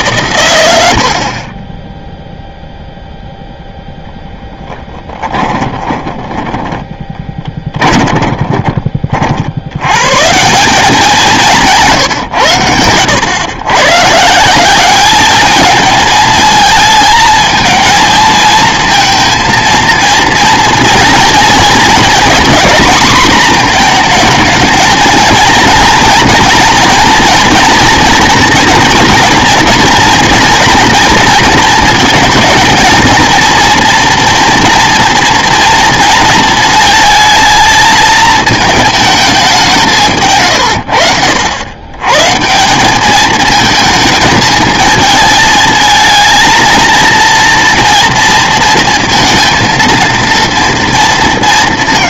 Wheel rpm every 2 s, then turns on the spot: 100, 0, 10, 20, 20, 170, 100, 190, 220, 230, 230, 240, 220, 230, 230, 230, 220, 230, 220, 220, 110, 170, 220, 230, 230, 230.
4-10